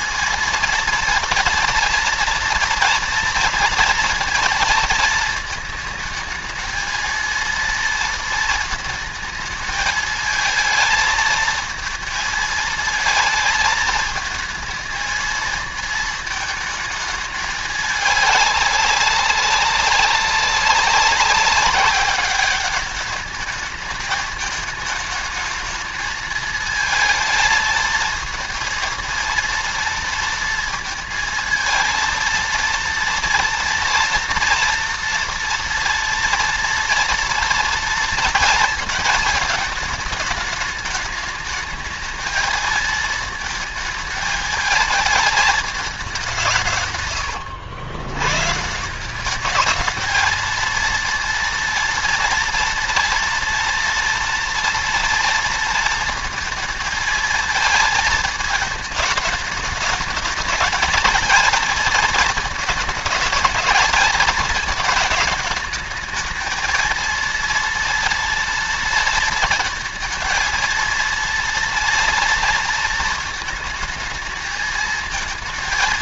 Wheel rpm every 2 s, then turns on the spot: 230, 230, 230, 220, 220, 220, 220, 220, 220, 200, 190, 200, 210, 220, 230, 230, 230, 230, 230, 220, 210, 220, 220, 130, 170, 230, 230, 230, 220, 220, 220, 220, 220, 230, 230, 230, 230, 220.
none